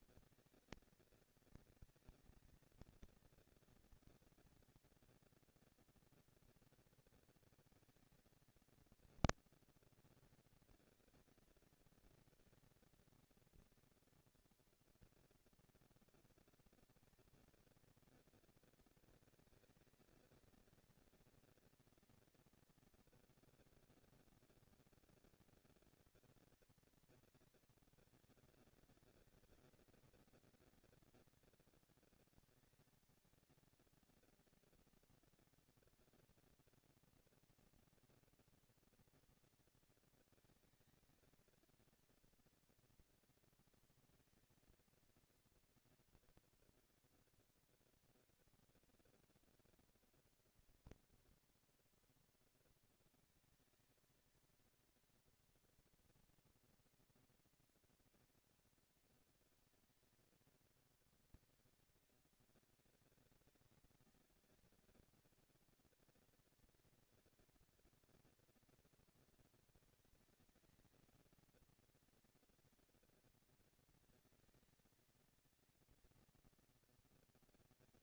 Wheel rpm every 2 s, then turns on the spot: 230, 230, 230, 230, 230, 230, 230, 230, 230, 230, 230, 230, 230, 230, 210, 200, 190, 230, 230, 230, 230, 230, 230, 230, 230, 230, 230, 230, 230, 230, 220, 190, 200, 220, 230, 220, 230, 230, 230.
none